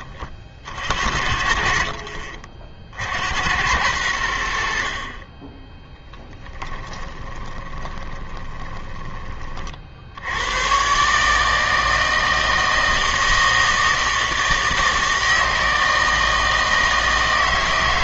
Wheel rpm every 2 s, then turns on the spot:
40, 50, 60, 20, 20, 110, 160, 160, 160.
6-10